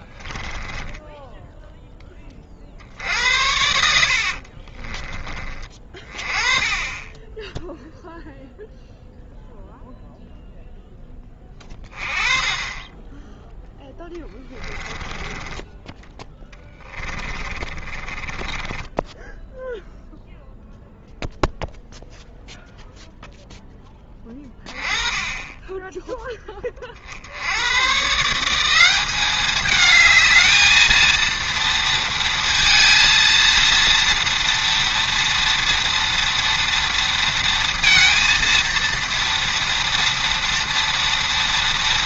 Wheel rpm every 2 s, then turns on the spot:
10, 50, 40, 20, 0, 0, 20, 20, 10, 20, 0, 0, 10, 50, 190, 220, 230, 230, 230, 230, 230.
0-2 4-6 14-20